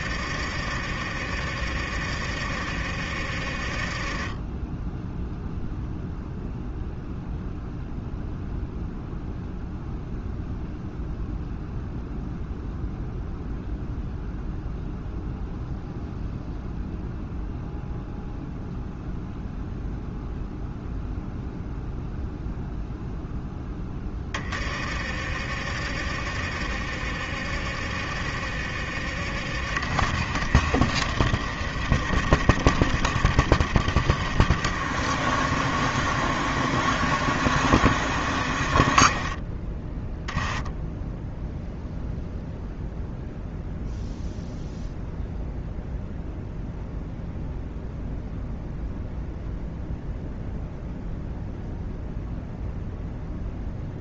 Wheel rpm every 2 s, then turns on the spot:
50, 50, 10, 0, 0, 0, 0, 0, 0, 0, 0, 0, 40, 50, 50, 40, 40, 50, 50, 30, 10, 0, 0, 0, 0, 0, 0.
none